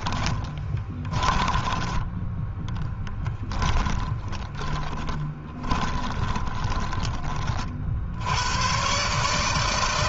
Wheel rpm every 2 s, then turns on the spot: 20, 10, 20, 30, 120.
0-2 4-8